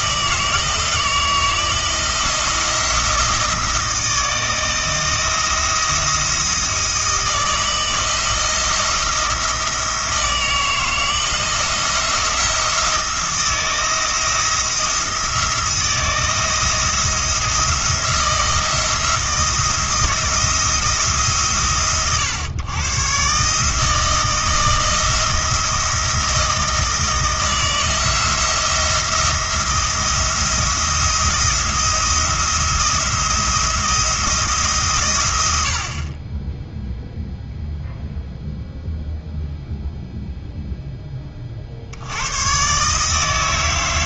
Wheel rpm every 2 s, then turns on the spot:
160, 170, 160, 160, 170, 160, 170, 170, 170, 170, 170, 120, 160, 160, 170, 170, 170, 140, 0, 0, 0, 140.
none